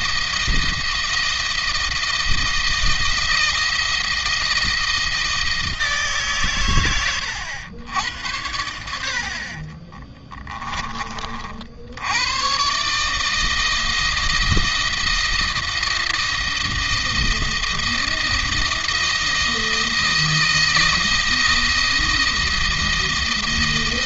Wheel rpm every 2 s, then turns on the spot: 170, 160, 160, 130, 80, 20, 130, 170, 160, 160, 160, 170.
none